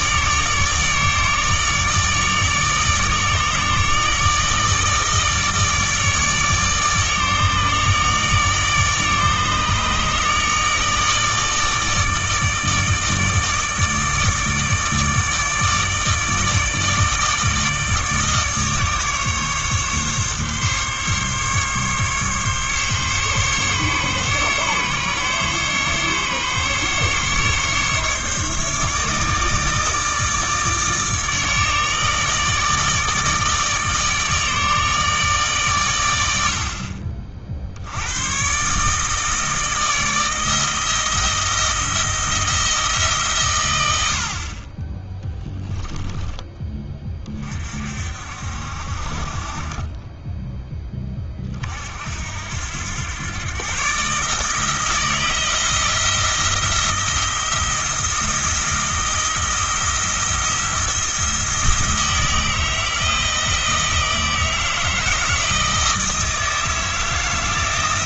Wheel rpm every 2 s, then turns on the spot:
150, 150, 150, 150, 150, 150, 150, 150, 150, 150, 140, 140, 140, 140, 150, 150, 150, 150, 60, 140, 160, 160, 30, 20, 60, 10, 90, 160, 170, 160, 170, 160, 160, 160.
none